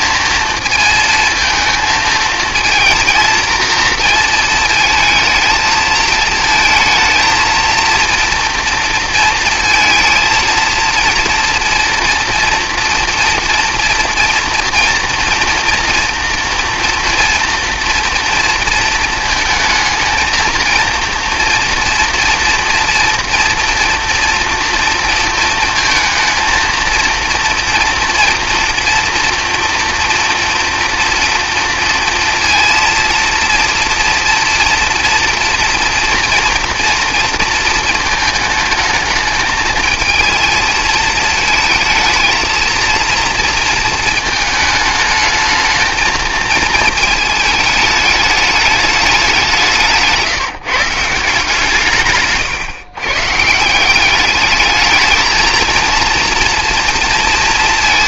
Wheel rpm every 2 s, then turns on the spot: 230, 230, 220, 230, 230, 230, 230, 230, 230, 230, 230, 240, 240, 230, 230, 230, 230, 230, 230, 220, 220, 230, 220, 220, 210, 160, 130, 210, 230.
none